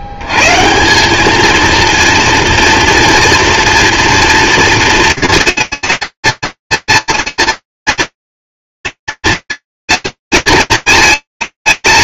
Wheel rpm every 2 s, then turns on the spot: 80, 230, 230, 230, 230, 230.
none